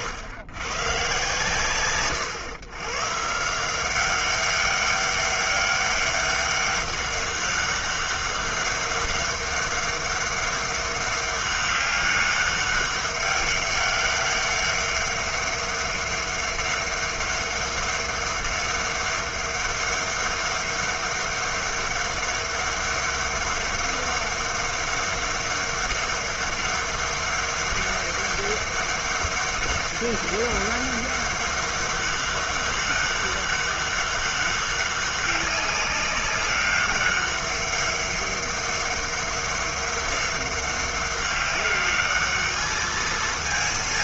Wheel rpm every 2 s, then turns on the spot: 120, 130, 200, 200, 200, 200, 200, 200, 200, 200, 200, 200, 200, 200, 200, 200, 200, 200, 200, 200, 200, 210.
none